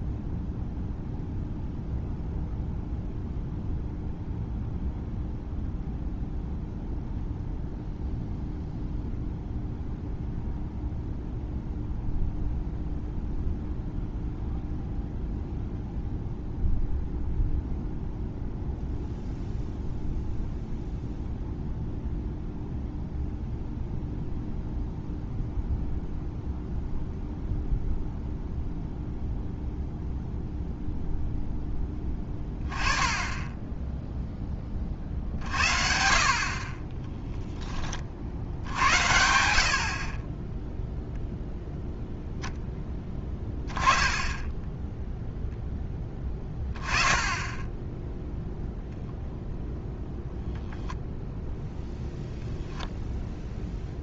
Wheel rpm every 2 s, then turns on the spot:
0, 0, 0, 0, 0, 0, 0, 0, 0, 0, 0, 0, 0, 0, 0, 0, 10, 20, 40, 70, 10, 0, 10, 20, 0, 0, 0.
none